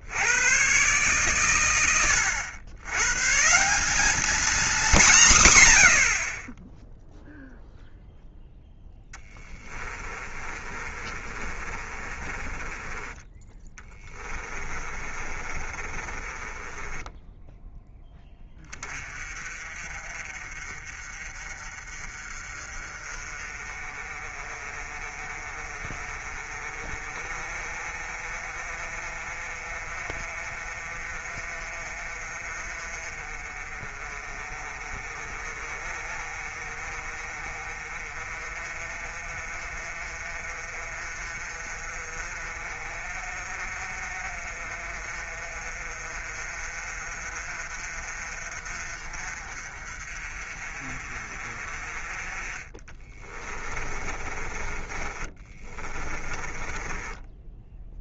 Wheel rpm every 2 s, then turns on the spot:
120, 100, 210, 10, 10, 30, 20, 20, 20, 20, 40, 40, 40, 40, 40, 40, 40, 40, 40, 40, 40, 40, 40, 40, 40, 40, 20, 20, 20.
10-18 54-58